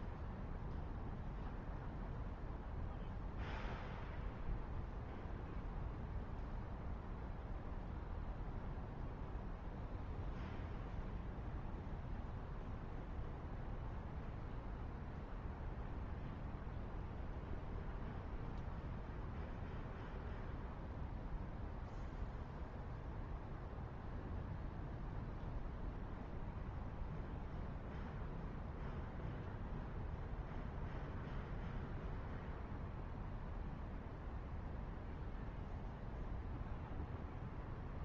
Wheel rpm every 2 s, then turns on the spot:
0, 0, 0, 0, 0, 0, 0, 0, 0, 0, 0, 0, 0, 0, 0, 0, 0, 0, 0.
none